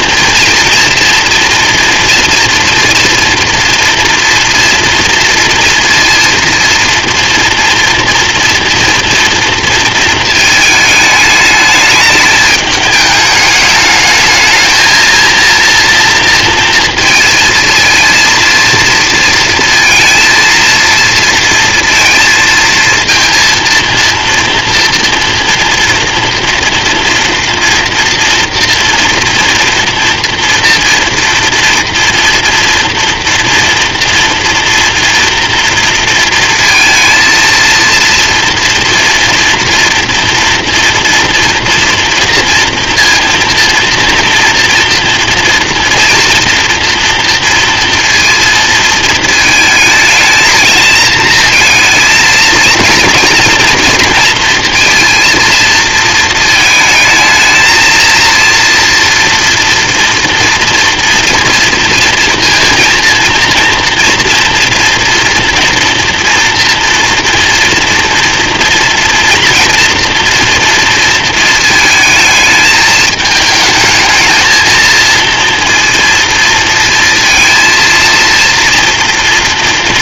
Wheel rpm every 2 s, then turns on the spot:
230, 230, 230, 230, 230, 220, 210, 220, 230, 240, 230, 230, 230, 230, 230, 230, 230, 230, 230, 230, 230, 230, 230, 230, 230, 220, 220, 230, 220, 230, 240, 230, 230, 240, 230, 230, 220, 220, 230, 230.
none